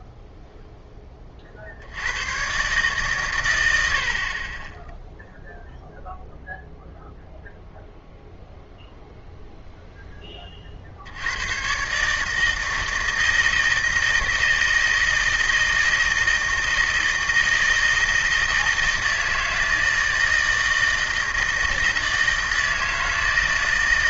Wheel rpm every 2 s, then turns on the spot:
10, 140, 10, 0, 0, 60, 160, 160, 160, 160, 160, 160.
none